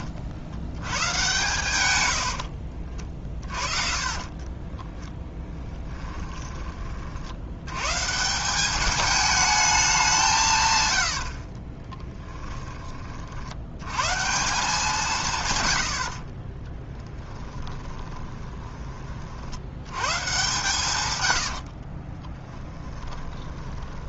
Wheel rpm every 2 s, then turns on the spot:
100, 50, 20, 30, 200, 120, 30, 170, 10, 30, 120, 10.
4-6 16-18 20-24